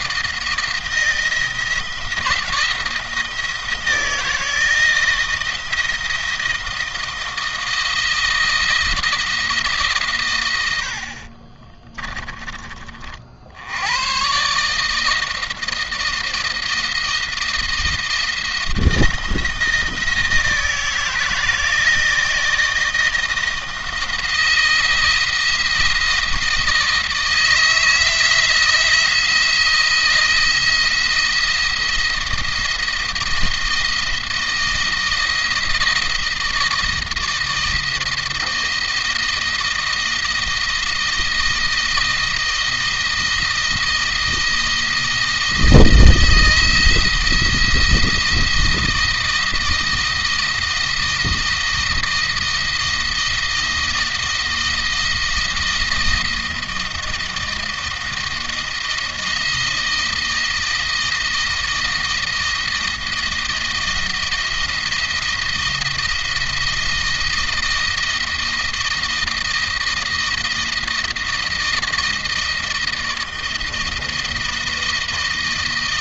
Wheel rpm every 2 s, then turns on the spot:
170, 160, 160, 170, 160, 80, 30, 140, 170, 170, 160, 160, 170, 160, 170, 170, 170, 170, 170, 170, 170, 160, 160, 160, 170, 160, 160, 160, 160, 160, 160, 160, 160, 170, 160, 160, 160, 170.
none